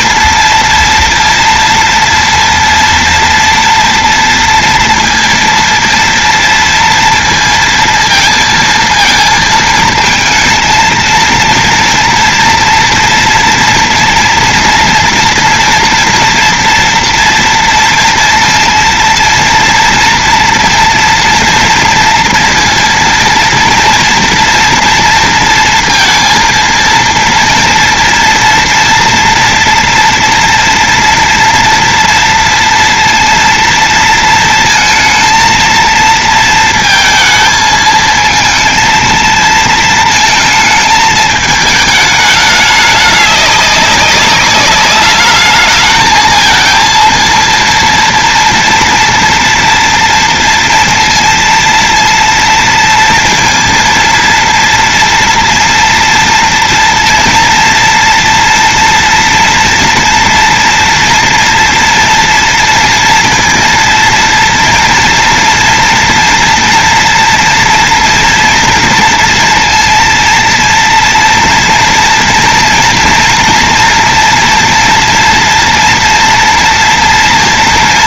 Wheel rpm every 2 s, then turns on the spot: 230, 230, 230, 230, 230, 230, 230, 230, 230, 230, 240, 230, 230, 230, 230, 240, 230, 230, 230, 220, 230, 210, 200, 220, 230, 230, 230, 230, 230, 230, 230, 230, 230, 230, 240, 230, 240, 240, 230.
none